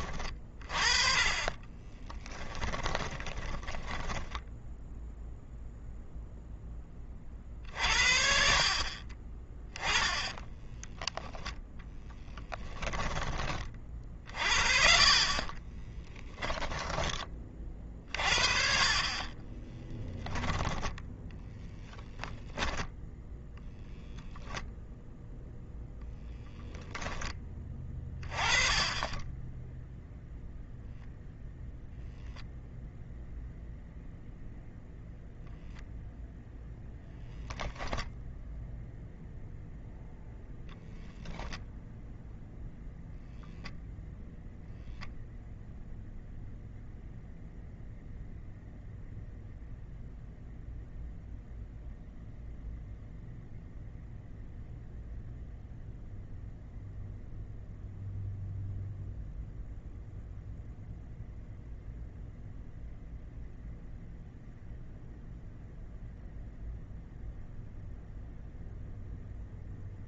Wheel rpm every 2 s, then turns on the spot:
30, 10, 0, 20, 40, 0, 20, 50, 10, 50, 10, 10, 10, 10, 20, 0, 0, 0, 0, 0, 0, 0, 0, 0, 0, 0, 0, 0, 0, 0, 0, 0, 0, 0, 0.
0-4 14-16